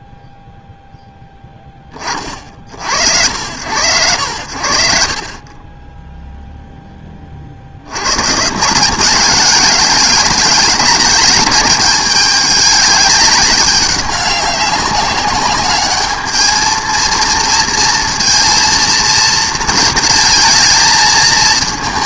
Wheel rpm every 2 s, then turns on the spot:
0, 80, 10, 40, 200, 200, 200, 200, 230, 220, 220.
none